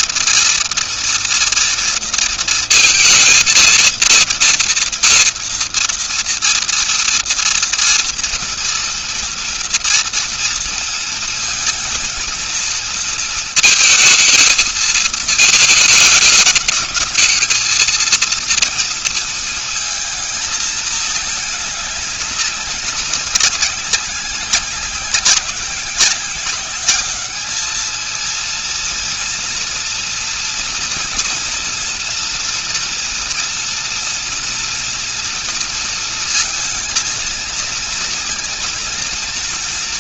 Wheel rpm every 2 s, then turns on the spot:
230, 230, 230, 230, 230, 230, 230, 220, 210, 230, 220, 200, 190, 190, 230, 230, 240, 240, 230, 230.
none